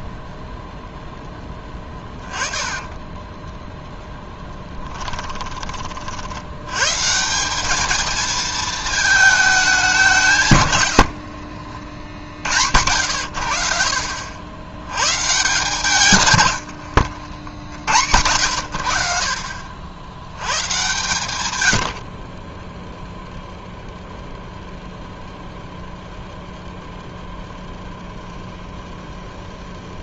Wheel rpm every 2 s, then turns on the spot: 0, 20, 10, 100, 220, 110, 90, 90, 90, 80, 110, 0, 0, 0, 0.
2-4 16-18